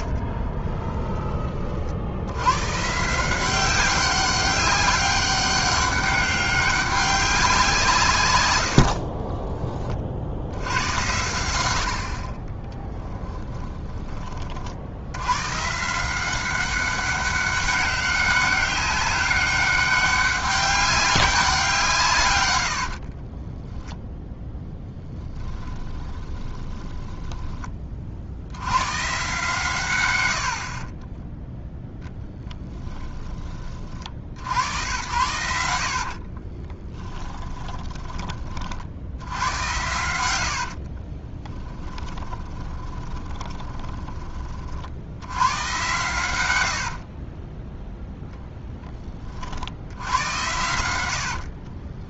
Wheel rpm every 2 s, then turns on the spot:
20, 130, 190, 200, 70, 90, 20, 70, 190, 200, 200, 80, 10, 20, 100, 40, 10, 90, 20, 60, 50, 20, 60, 70, 10, 90.
0-2 8-10 12-14 22-24 26-28 30-32 36-38 40-44 46-48